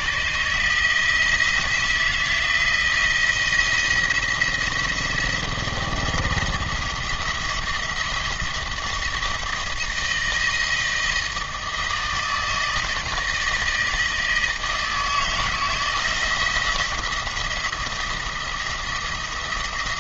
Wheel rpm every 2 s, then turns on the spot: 160, 170, 170, 170, 170, 160, 160, 160, 170, 170.
none